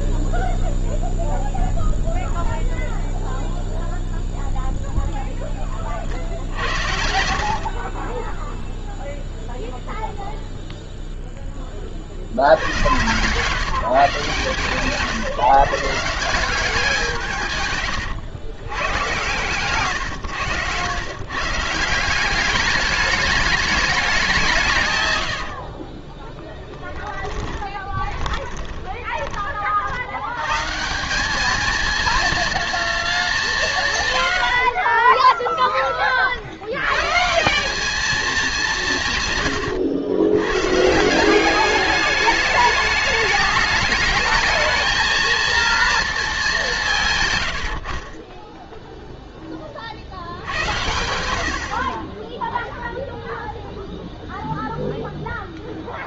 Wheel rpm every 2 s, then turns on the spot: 0, 0, 0, 70, 0, 0, 100, 140, 180, 100, 110, 200, 140, 20, 20, 140, 230, 30, 100, 180, 150, 210, 220, 170, 0, 90, 0, 0.
6-8 24-30 34-36